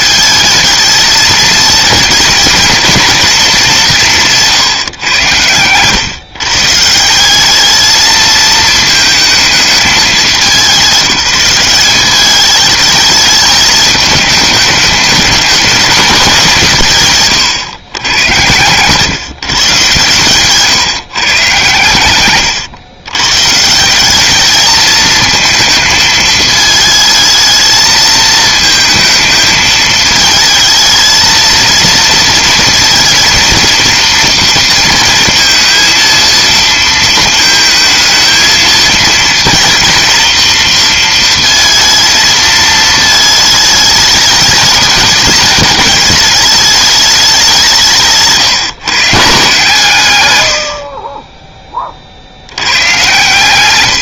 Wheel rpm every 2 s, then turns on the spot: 220, 230, 160, 150, 220, 190, 210, 210, 160, 110, 140, 110, 210, 220, 220, 220, 230, 230, 230, 220, 230, 220, 210, 210, 140, 80, 100.
none